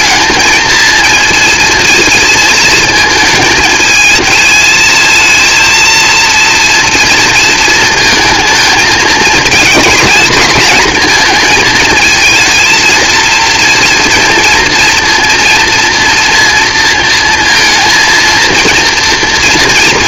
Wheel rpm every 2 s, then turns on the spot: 230, 230, 220, 230, 220, 220, 230, 230, 230, 230.
none